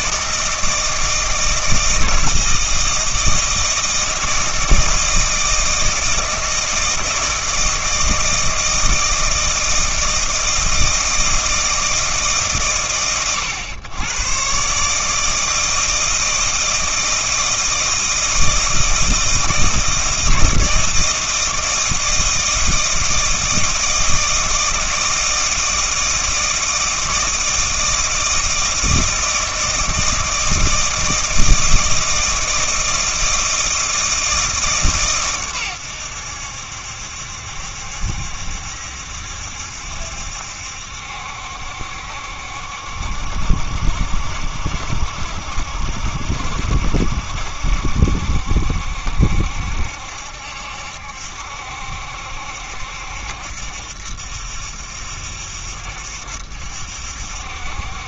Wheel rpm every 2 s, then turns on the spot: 160, 160, 160, 160, 160, 160, 110, 130, 160, 160, 160, 160, 160, 160, 160, 160, 160, 150, 80, 70, 70, 70, 70, 70, 70, 70, 70, 70, 70.
none